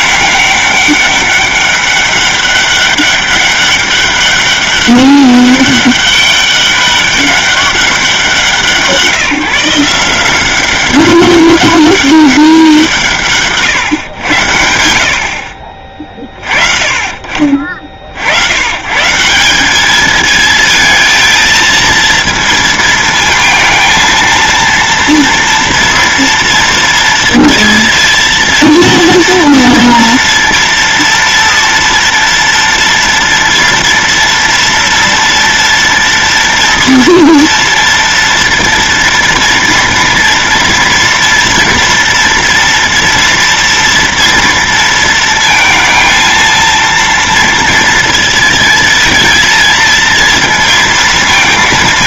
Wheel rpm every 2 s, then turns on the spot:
200, 200, 200, 200, 170, 190, 180, 80, 40, 130, 220, 230, 230, 230, 230, 230, 230, 230, 230, 240, 230, 230, 230, 230, 230, 220.
none